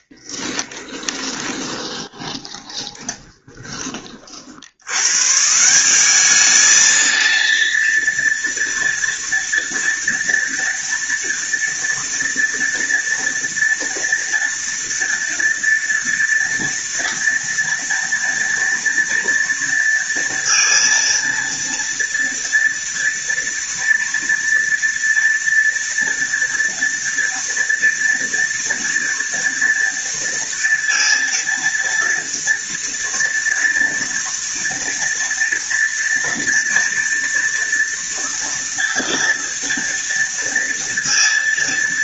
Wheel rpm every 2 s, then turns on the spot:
10, 20, 110, 220, 230, 230, 230, 230, 230, 230, 230, 230, 230, 230, 230, 230, 230, 230, 230, 230, 230.
0-4